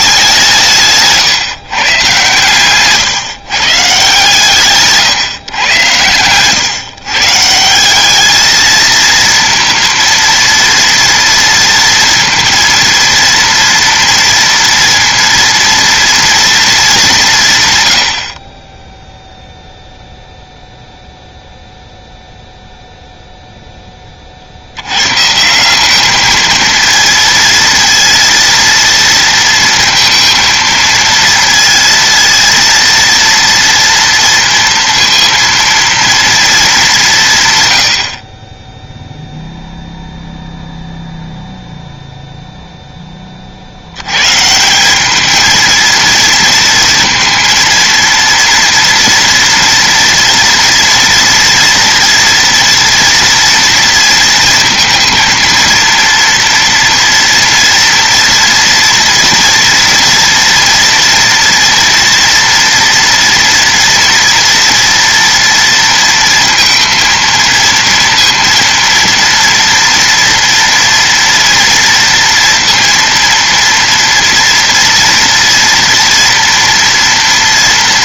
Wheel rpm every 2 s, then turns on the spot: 160, 130, 140, 130, 230, 230, 230, 230, 210, 10, 0, 0, 70, 220, 230, 230, 230, 230, 220, 20, 0, 0, 160, 230, 230, 230, 230, 230, 230, 230, 230, 230, 230, 230, 230, 240, 230, 230, 230.
none